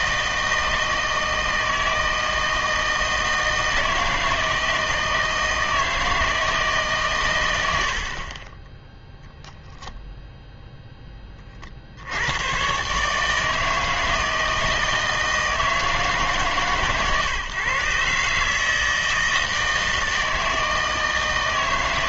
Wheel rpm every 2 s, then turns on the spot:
160, 160, 160, 150, 10, 0, 130, 160, 140, 150, 160.
none